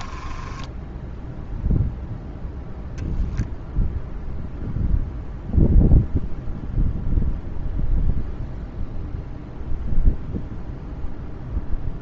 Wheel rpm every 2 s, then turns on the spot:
10, 0, 0, 0, 0, 0.
0-2